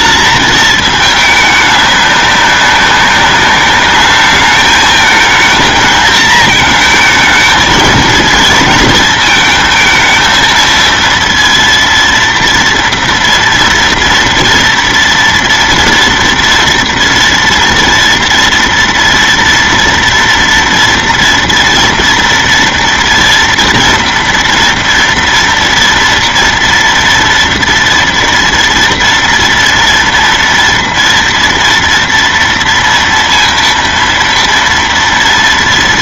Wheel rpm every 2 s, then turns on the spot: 220, 200, 220, 220, 230, 230, 230, 230, 230, 230, 230, 230, 230, 230, 230, 230, 230, 230.
none